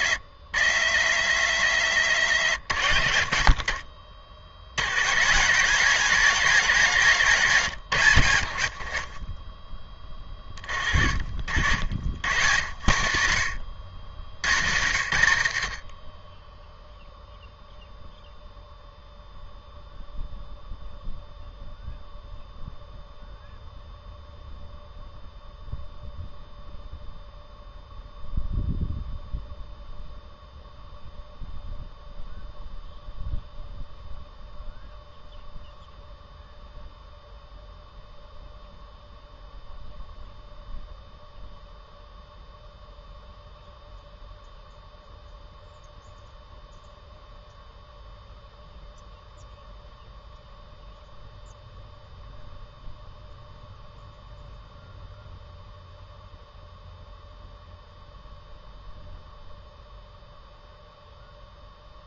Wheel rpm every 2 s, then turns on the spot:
70, 90, 70, 150, 70, 30, 80, 80, 10, 0, 0, 0, 0, 0, 0, 0, 0, 0, 0, 0, 0, 0, 0, 0, 0, 0, 0, 0, 0, 0, 0.
none